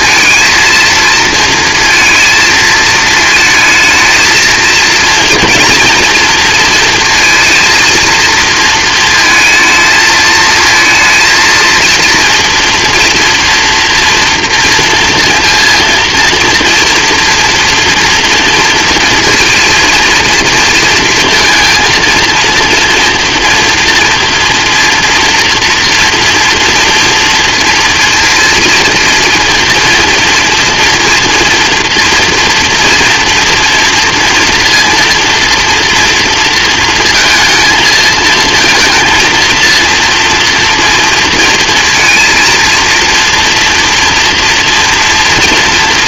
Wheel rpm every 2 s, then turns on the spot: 230, 220, 220, 230, 230, 220, 230, 230, 230, 230, 230, 230, 240, 230, 230, 230, 230, 230, 230, 220, 230, 230, 230.
none